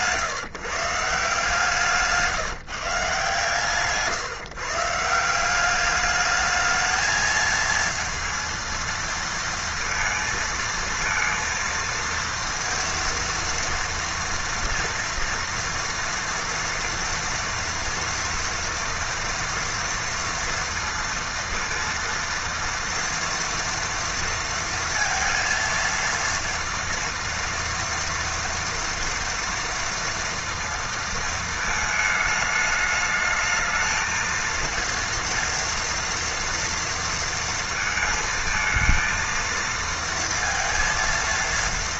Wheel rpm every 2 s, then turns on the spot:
160, 160, 160, 220, 230, 230, 230, 230, 230, 230, 230, 230, 230, 230, 230, 230, 210, 230, 230, 230, 230.
none